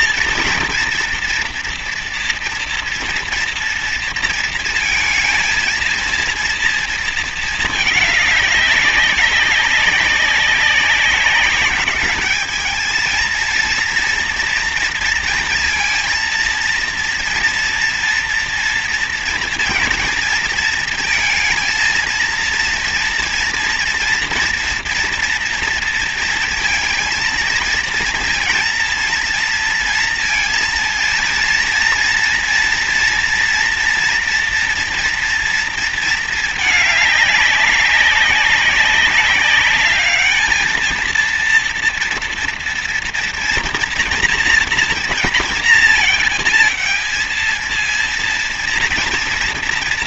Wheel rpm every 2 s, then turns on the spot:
230, 230, 230, 230, 200, 190, 220, 230, 230, 230, 220, 230, 230, 230, 230, 230, 240, 240, 210, 200, 220, 240, 230, 220, 230.
none